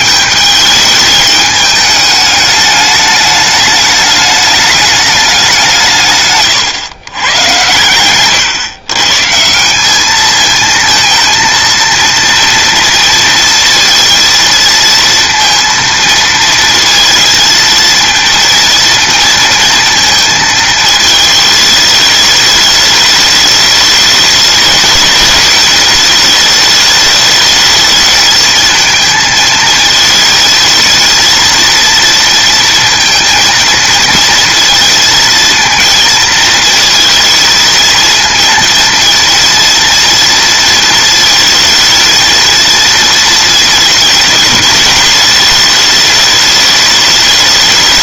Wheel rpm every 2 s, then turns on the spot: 210, 210, 210, 140, 120, 210, 230, 230, 230, 230, 230, 220, 210, 210, 220, 220, 230, 230, 220, 230, 230, 220, 220, 210.
none